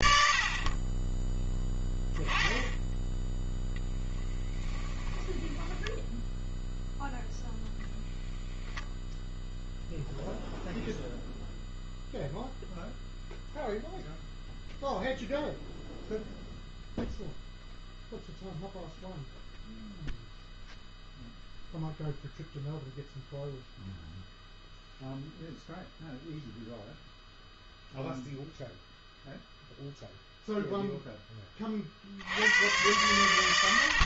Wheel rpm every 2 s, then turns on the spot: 50, 10, 20, 0, 0, 0, 0, 0, 0, 0, 0, 0, 0, 0, 0, 0, 100.
4-6